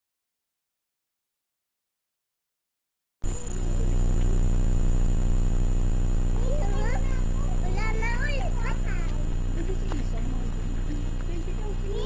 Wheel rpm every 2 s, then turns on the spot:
0, 0, 0, 0, 0, 0.
none